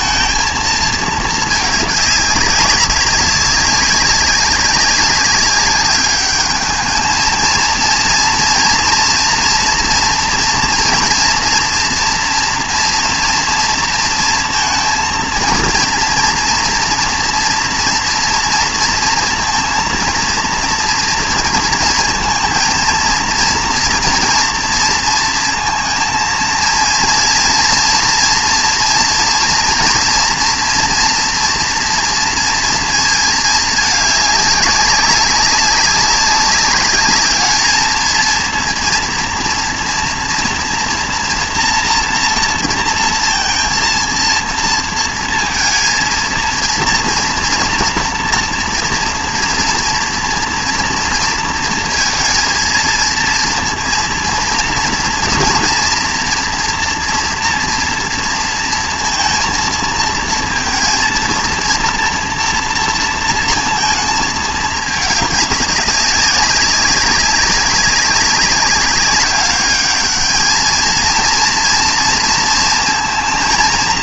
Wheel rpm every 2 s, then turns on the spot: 230, 190, 190, 210, 230, 230, 230, 230, 230, 230, 230, 230, 230, 230, 230, 230, 230, 200, 200, 230, 230, 230, 230, 230, 230, 240, 230, 230, 230, 230, 230, 230, 220, 190, 200, 220, 230.
none